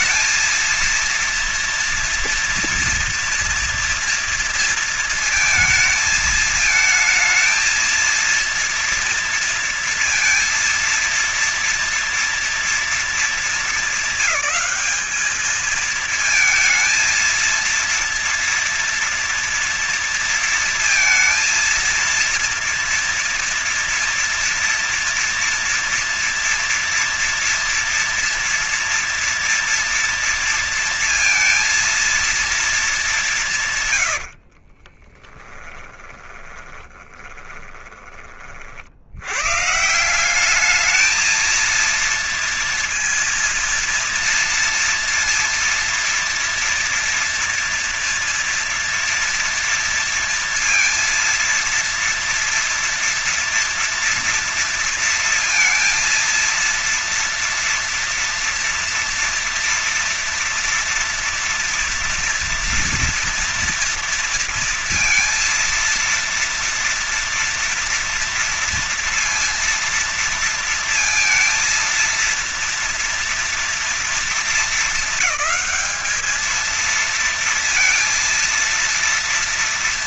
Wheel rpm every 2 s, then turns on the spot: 230, 230, 230, 220, 230, 230, 230, 220, 230, 230, 230, 230, 230, 230, 230, 230, 230, 80, 20, 40, 190, 230, 230, 230, 240, 230, 230, 240, 230, 240, 230, 230, 230, 230, 240, 230, 230, 230, 220, 230.
34-38